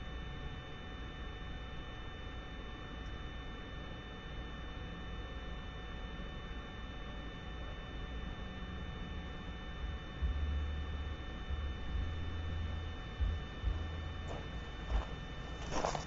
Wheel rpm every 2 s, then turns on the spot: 0, 0, 0, 0, 0, 0, 0, 0.
none